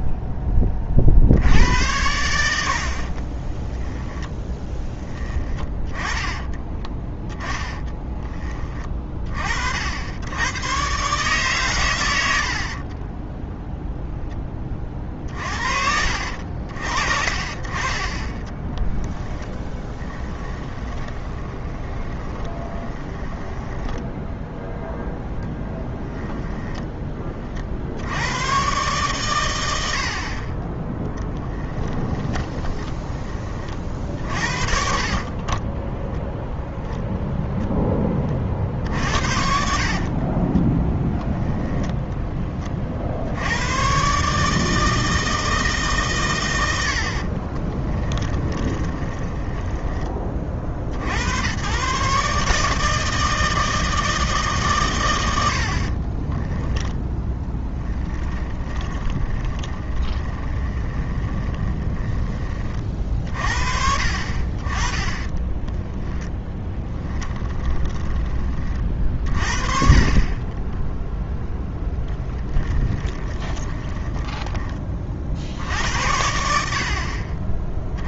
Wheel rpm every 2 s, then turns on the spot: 20, 70, 10, 10, 20, 110, 50, 20, 60, 10, 20, 20, 10, 20, 120, 20, 10, 40, 0, 50, 10, 30, 150, 100, 20, 40, 150, 130, 10, 20, 20, 30, 30, 10, 40, 10, 20, 20, 60.
6-8 18-24 26-28 32-34 40-42 48-50 56-62 66-68 70-74